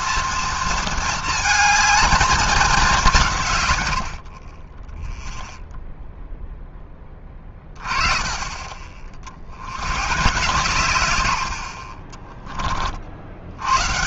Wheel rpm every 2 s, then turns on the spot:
230, 210, 20, 0, 30, 140, 30.
none